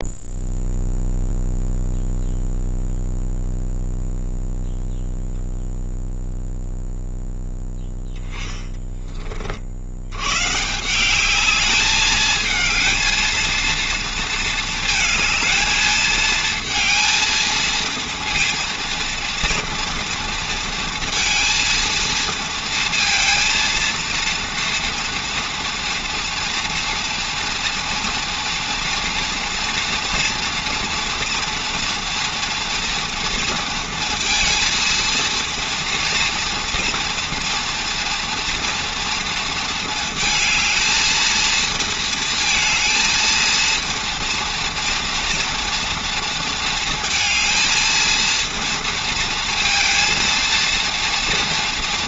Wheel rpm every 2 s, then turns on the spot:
0, 0, 0, 0, 20, 140, 220, 220, 230, 230, 230, 230, 230, 230, 230, 240, 230, 230, 240, 240, 220, 230, 230, 230, 230, 230.
8-10